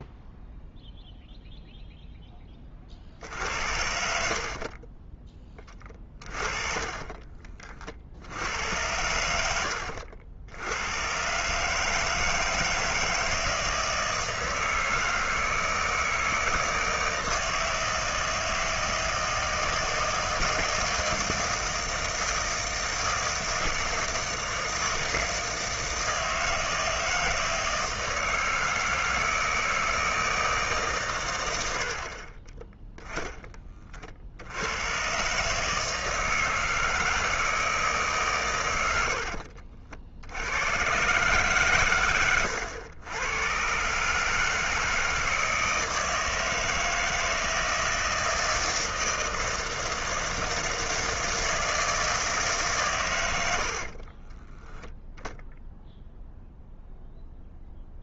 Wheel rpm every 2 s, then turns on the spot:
0, 30, 40, 30, 90, 90, 160, 160, 160, 160, 160, 160, 160, 160, 160, 150, 20, 80, 160, 110, 100, 100, 160, 160, 160, 160, 140, 10, 0.
4-8 54-56